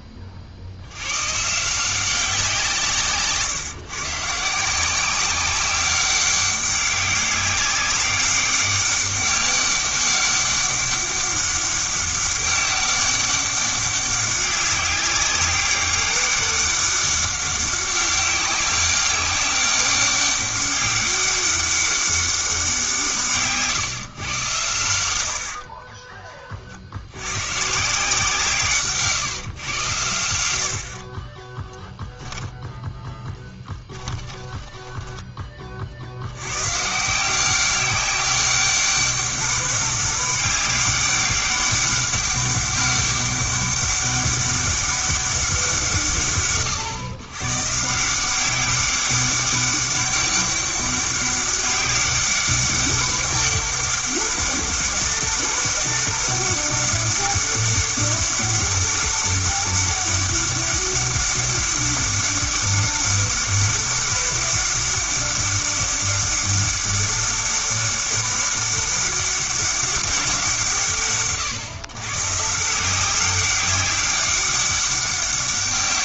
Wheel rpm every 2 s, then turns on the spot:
90, 160, 170, 200, 200, 200, 200, 190, 200, 200, 200, 180, 100, 70, 140, 60, 10, 20, 150, 200, 200, 200, 200, 130, 200, 200, 200, 200, 200, 200, 200, 200, 200, 200, 200, 140, 180, 200.
28-30 32-36